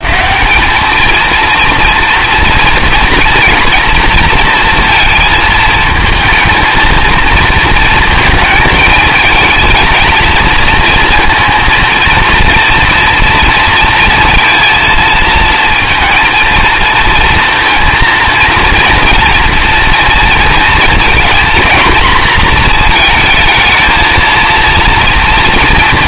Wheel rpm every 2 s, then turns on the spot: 200, 230, 230, 220, 220, 230, 230, 230, 230, 230, 230, 230, 230.
none